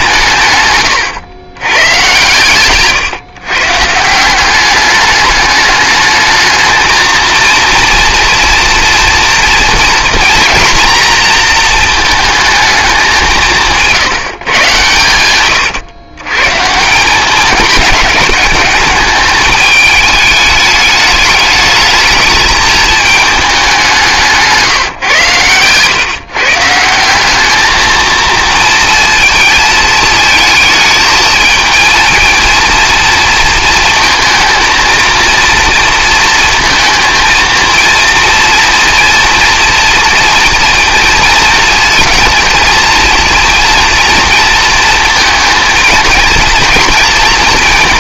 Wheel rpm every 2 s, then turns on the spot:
120, 140, 190, 220, 230, 240, 220, 130, 140, 210, 210, 220, 160, 160, 230, 220, 230, 230, 220, 230, 230, 220, 230, 220.
0-2 24-26